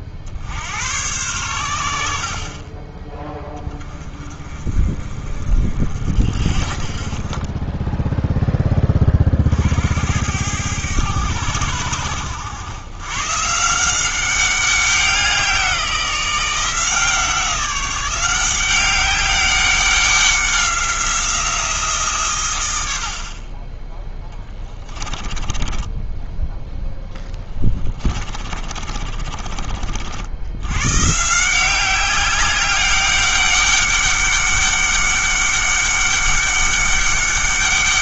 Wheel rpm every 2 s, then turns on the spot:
90, 30, 30, 40, 10, 100, 100, 190, 170, 190, 180, 100, 20, 10, 30, 110, 200, 200, 200.
24-26 28-30